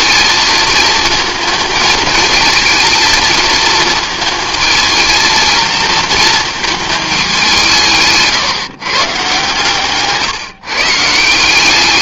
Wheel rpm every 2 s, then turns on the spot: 220, 220, 220, 220, 140, 150.
none